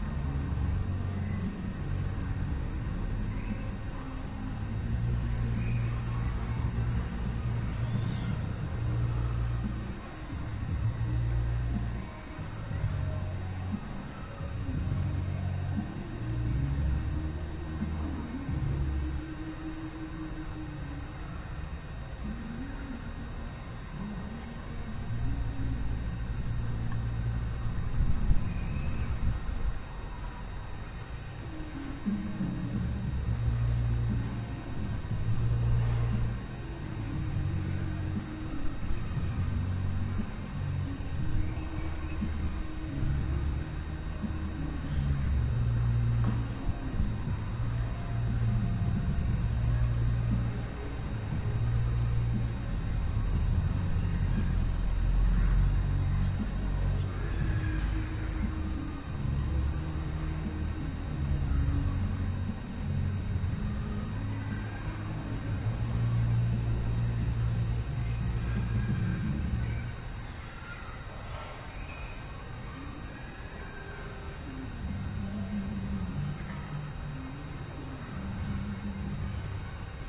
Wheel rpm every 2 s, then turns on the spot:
0, 0, 0, 0, 0, 0, 0, 0, 0, 0, 0, 0, 0, 0, 0, 0, 0, 0, 0, 0, 0, 0, 0, 0, 0, 0, 0, 0, 0, 0, 0, 0, 0, 0, 0, 0, 0, 0, 0, 0.
none